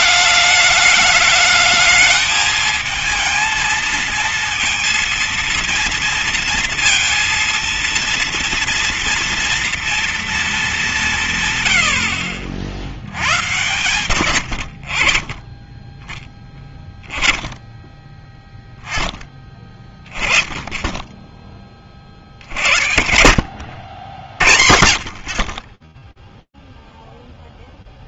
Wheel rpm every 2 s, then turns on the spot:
200, 210, 230, 230, 230, 230, 70, 100, 20, 0, 10, 40, 60, 0.
none